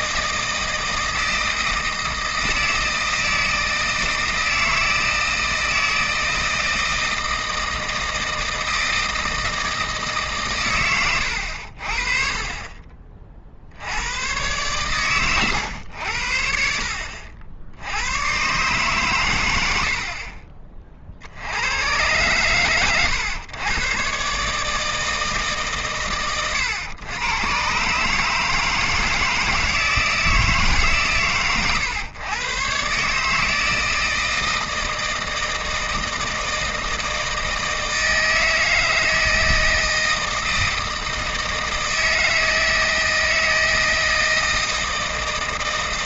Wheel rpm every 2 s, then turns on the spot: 160, 160, 160, 160, 160, 120, 30, 120, 70, 140, 30, 120, 150, 120, 160, 150, 120, 160, 160, 160, 160, 160, 160.
none